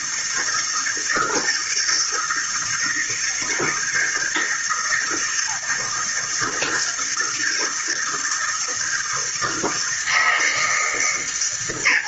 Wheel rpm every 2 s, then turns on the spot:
160, 160, 160, 160, 160, 150.
none